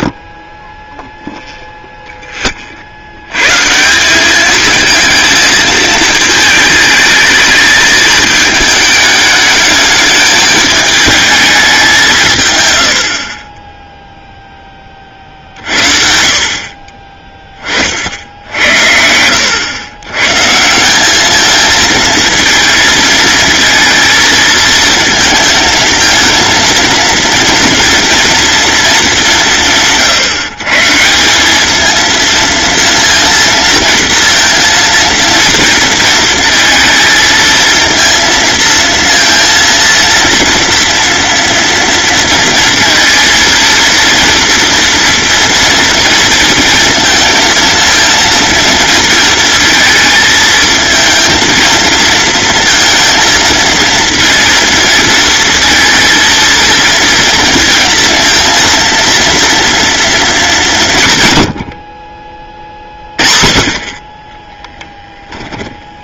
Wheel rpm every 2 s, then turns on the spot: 10, 60, 220, 220, 210, 220, 90, 30, 30, 70, 170, 230, 220, 230, 220, 160, 230, 230, 230, 230, 230, 230, 230, 230, 230, 230, 220, 230, 230, 230, 180, 30, 10.
64-66